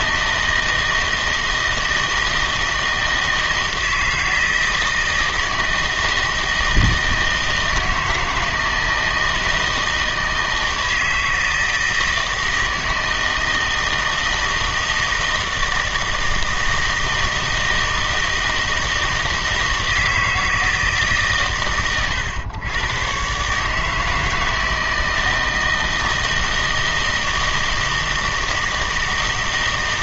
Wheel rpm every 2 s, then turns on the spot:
160, 160, 160, 160, 160, 160, 160, 160, 160, 160, 160, 110, 160, 160, 160.
none